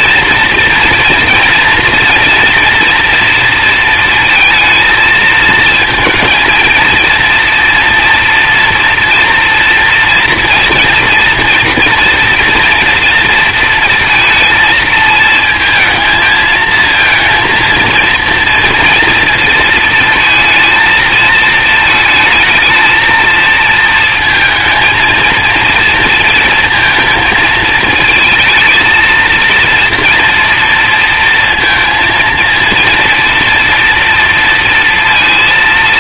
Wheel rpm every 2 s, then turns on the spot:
230, 230, 230, 230, 230, 230, 230, 220, 220, 230, 220, 220, 220, 230, 220, 230, 230, 230.
none